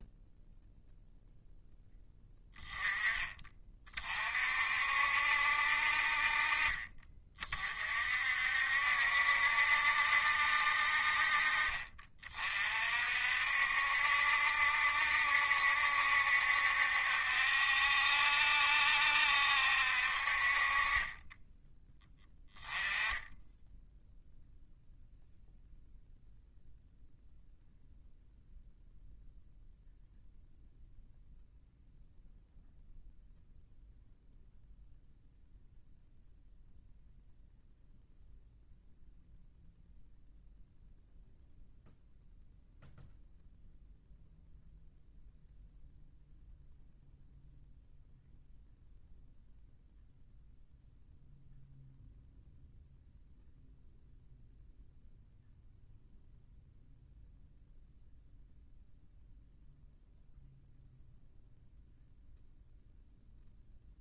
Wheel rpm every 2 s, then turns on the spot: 0, 10, 60, 30, 70, 50, 50, 70, 70, 70, 40, 10, 0, 0, 0, 0, 0, 0, 0, 0, 0, 0, 0, 0, 0, 0, 0, 0, 0, 0, 0, 0.
none